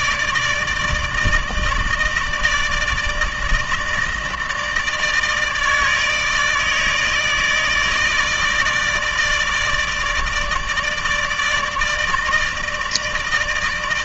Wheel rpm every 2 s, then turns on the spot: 160, 160, 160, 160, 150, 150, 160.
none